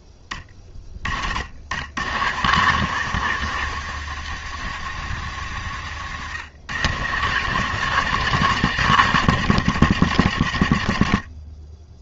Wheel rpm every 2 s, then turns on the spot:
30, 120, 130, 110, 140, 100.
none